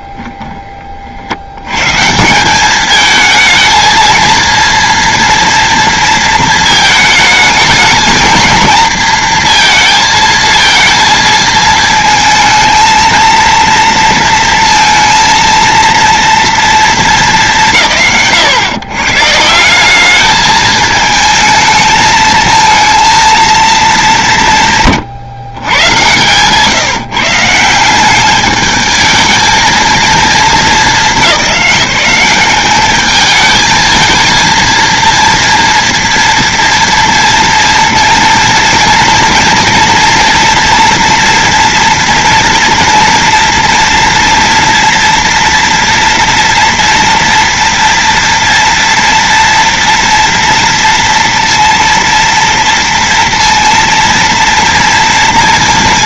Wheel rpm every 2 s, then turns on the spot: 20, 150, 220, 230, 220, 230, 220, 230, 230, 120, 210, 220, 210, 120, 190, 230, 200, 220, 230, 230, 230, 230, 230, 230, 230, 230, 230, 230.
0-2 26-28